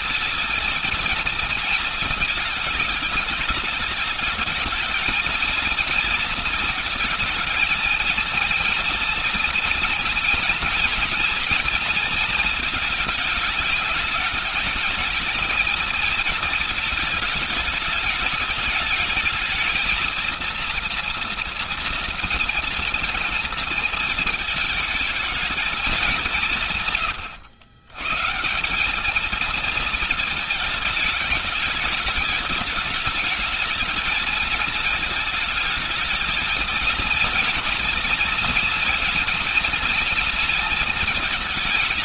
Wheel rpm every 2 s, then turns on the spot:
230, 210, 230, 230, 230, 230, 220, 220, 220, 220, 230, 230, 220, 130, 210, 220, 220, 220, 230, 230, 230.
none